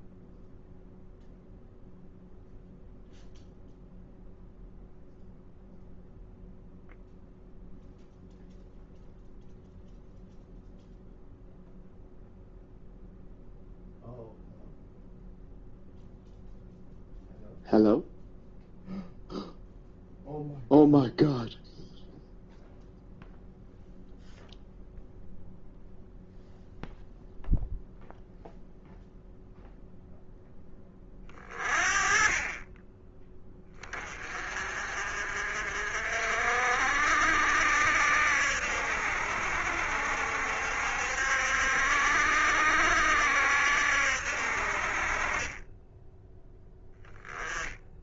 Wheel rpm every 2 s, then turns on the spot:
0, 0, 0, 0, 0, 0, 0, 0, 0, 0, 0, 0, 0, 0, 0, 20, 20, 50, 60, 70, 60, 70, 50, 10.
none